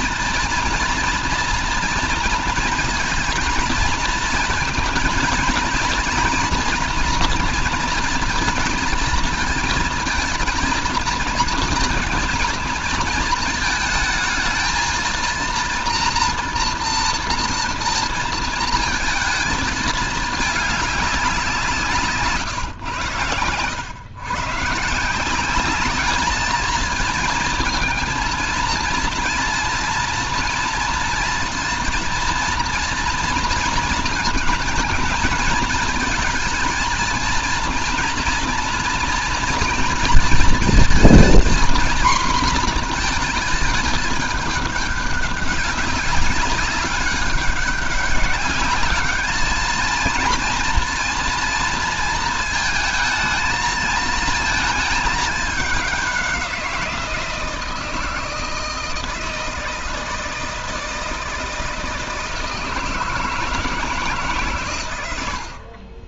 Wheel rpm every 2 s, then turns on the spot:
230, 230, 230, 240, 230, 230, 220, 230, 230, 230, 210, 120, 150, 220, 230, 230, 230, 220, 230, 230, 230, 230, 200, 200, 200, 230, 220, 210, 170, 160, 160, 160, 130.
none